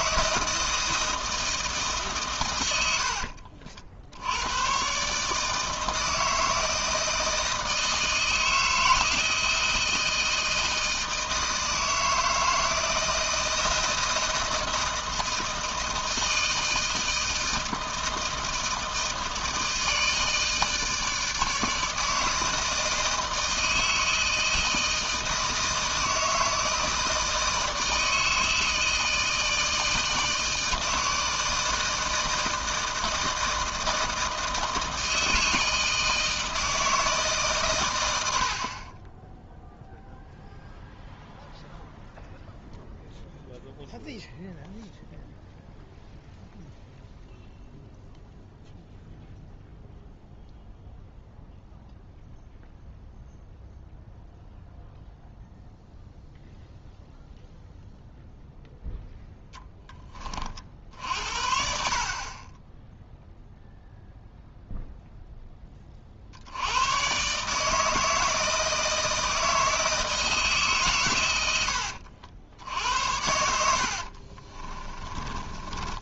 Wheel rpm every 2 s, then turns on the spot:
160, 100, 120, 160, 160, 160, 160, 160, 160, 160, 160, 160, 160, 160, 160, 160, 160, 160, 160, 40, 0, 0, 0, 0, 0, 0, 0, 0, 0, 0, 50, 10, 0, 90, 160, 140, 80, 30.
74-76